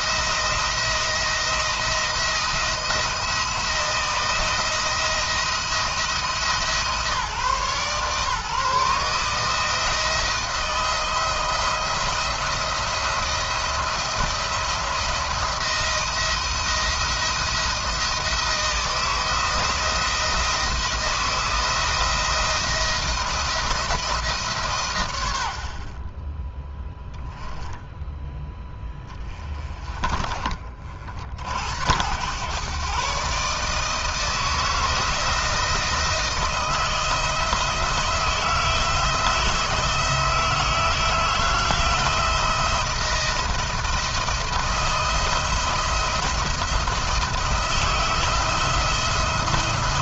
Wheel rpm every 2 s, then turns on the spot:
170, 170, 170, 160, 150, 160, 160, 170, 170, 160, 170, 170, 130, 0, 10, 50, 130, 160, 170, 160, 170, 170, 170, 160, 160.
none